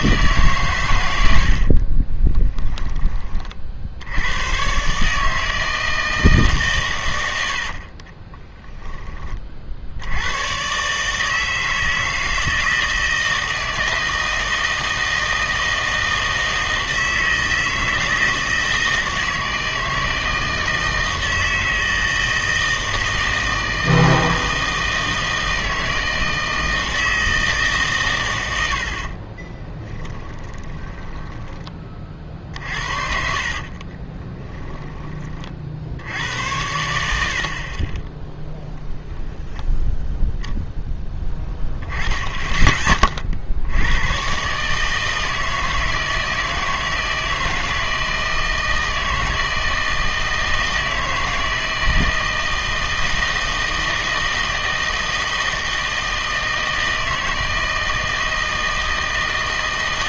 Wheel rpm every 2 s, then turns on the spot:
130, 10, 120, 130, 10, 130, 160, 160, 160, 160, 160, 160, 160, 160, 90, 20, 50, 20, 80, 0, 0, 20, 150, 160, 160, 160, 160, 160, 160, 160.
30-36